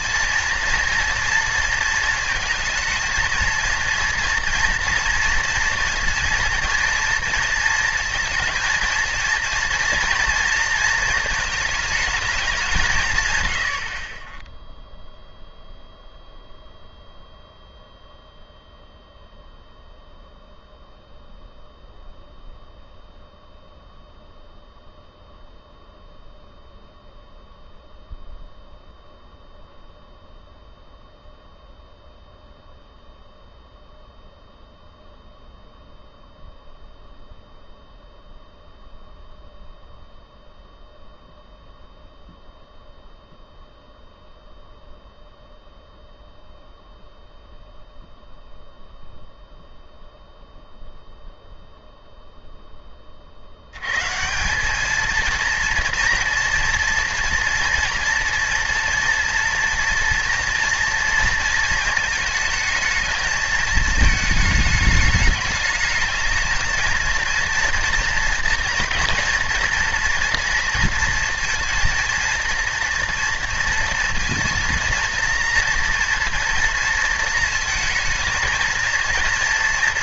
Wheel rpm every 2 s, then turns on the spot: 230, 230, 230, 230, 230, 230, 170, 0, 0, 0, 0, 0, 0, 0, 0, 0, 0, 0, 0, 0, 0, 0, 0, 0, 0, 0, 20, 210, 230, 230, 240, 230, 210, 220, 230, 230, 240, 230, 240, 230.
none